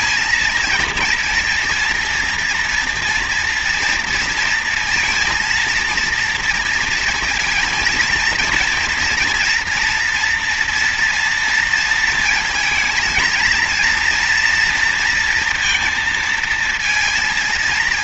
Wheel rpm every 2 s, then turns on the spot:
230, 240, 230, 230, 230, 230, 230, 230, 230.
none